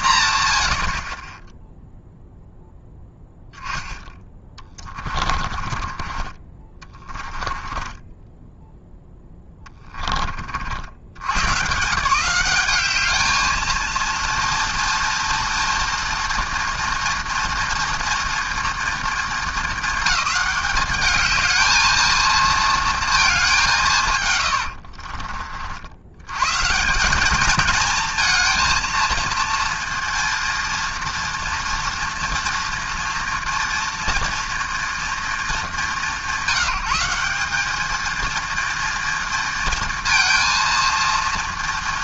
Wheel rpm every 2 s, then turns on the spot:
60, 0, 30, 20, 10, 80, 200, 230, 230, 230, 210, 230, 70, 170, 230, 230, 230, 230, 180, 230, 230.
4-8 24-26